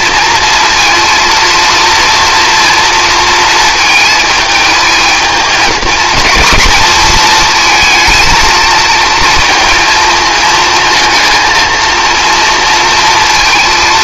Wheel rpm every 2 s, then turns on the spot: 230, 230, 220, 230, 230, 230, 230.
none